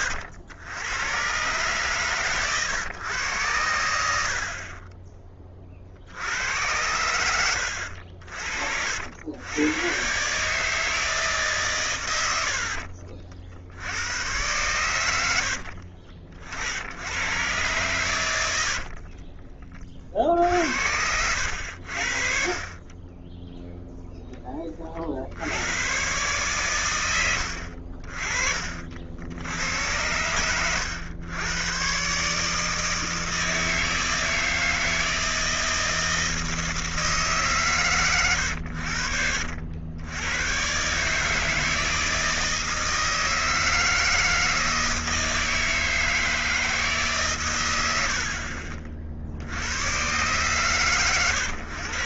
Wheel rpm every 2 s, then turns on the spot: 100, 130, 40, 80, 60, 150, 60, 100, 60, 70, 70, 40, 20, 120, 50, 100, 150, 160, 160, 90, 130, 160, 160, 160, 50, 130.
12-14 18-22